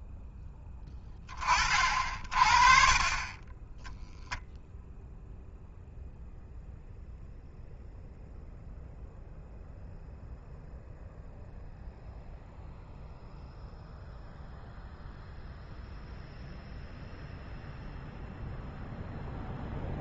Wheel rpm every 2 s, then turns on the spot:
10, 40, 0, 0, 0, 0, 0, 0, 0, 0.
none